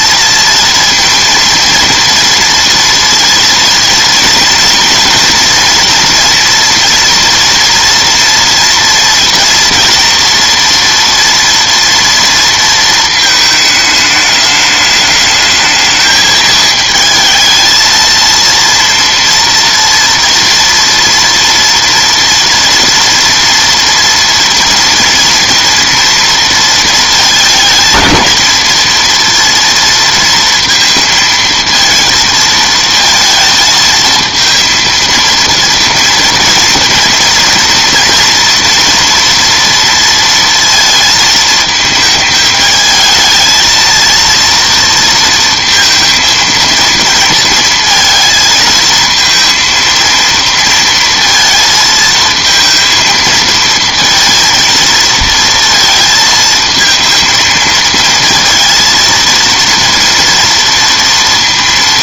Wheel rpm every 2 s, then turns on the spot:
230, 230, 230, 230, 230, 230, 230, 210, 220, 230, 240, 230, 230, 230, 220, 230, 230, 230, 230, 230, 230, 220, 230, 230, 220, 230, 230, 230, 220, 230, 230.
none